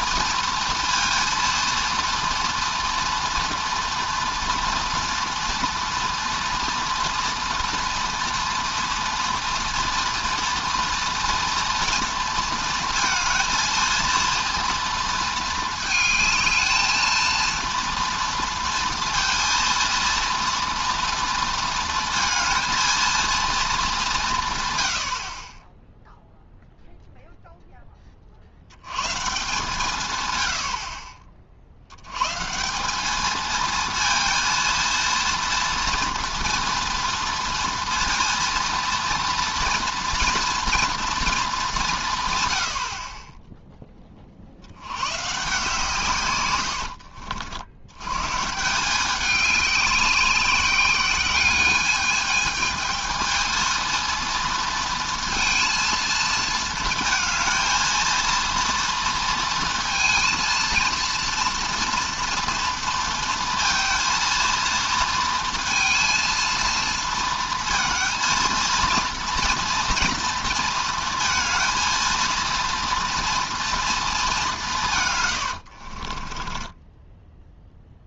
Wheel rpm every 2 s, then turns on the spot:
230, 230, 240, 230, 230, 230, 230, 230, 220, 240, 230, 230, 110, 0, 90, 80, 170, 230, 230, 230, 230, 100, 70, 100, 160, 190, 220, 230, 220, 230, 230, 230, 230, 230, 230, 230, 230, 180, 10.
76-78